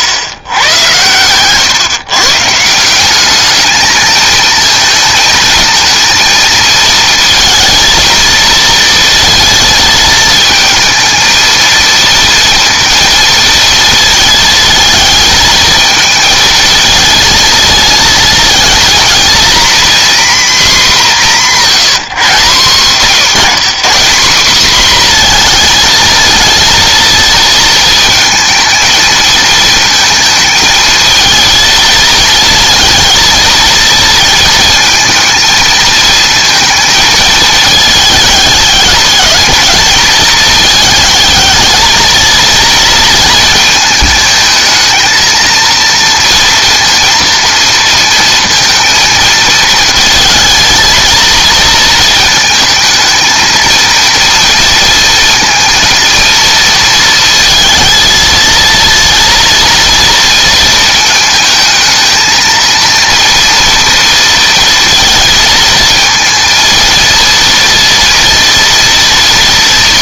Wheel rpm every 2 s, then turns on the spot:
110, 170, 220, 230, 230, 220, 230, 220, 220, 230, 230, 130, 230, 230, 220, 220, 220, 230, 230, 210, 220, 230, 220, 230, 230, 220, 220, 230, 230, 230, 230, 230, 230, 230, 230.
none